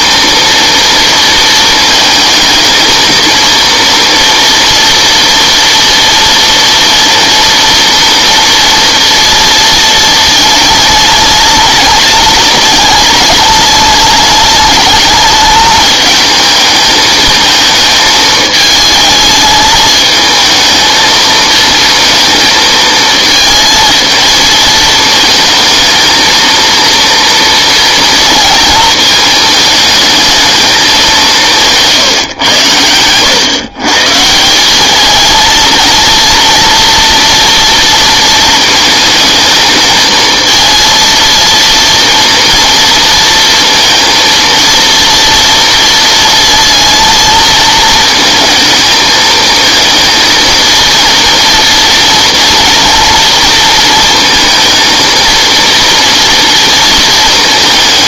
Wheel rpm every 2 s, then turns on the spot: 230, 230, 230, 230, 230, 220, 210, 210, 220, 220, 220, 230, 220, 230, 230, 210, 110, 180, 230, 220, 230, 230, 230, 230, 230, 220, 230, 230, 230.
none